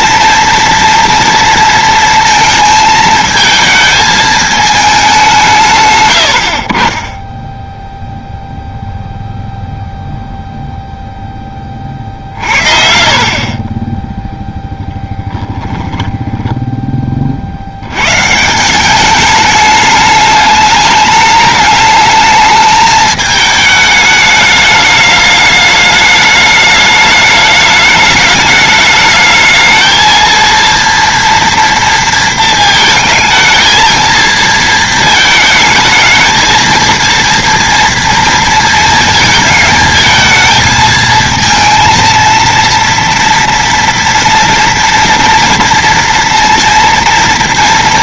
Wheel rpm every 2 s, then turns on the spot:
230, 220, 210, 30, 0, 0, 50, 0, 20, 180, 210, 210, 210, 210, 210, 230, 220, 220, 230, 230, 220, 230, 230, 230.
16-18